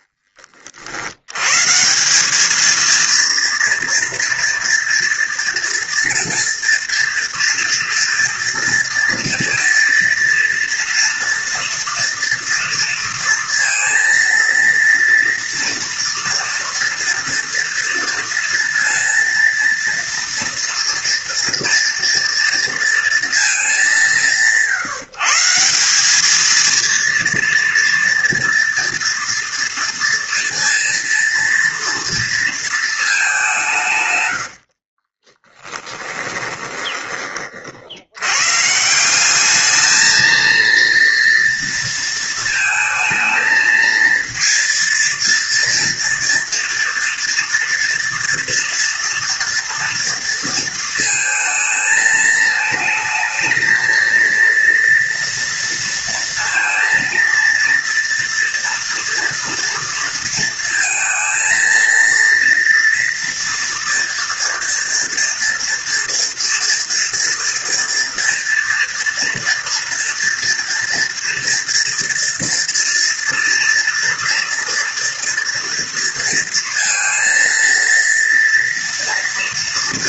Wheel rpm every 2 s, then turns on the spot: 40, 220, 230, 230, 240, 230, 230, 230, 230, 230, 230, 230, 160, 230, 230, 230, 220, 50, 20, 150, 230, 230, 230, 230, 230, 230, 220, 230, 230, 240, 230, 230, 230, 230, 230, 230, 230, 240, 230, 230.
34-38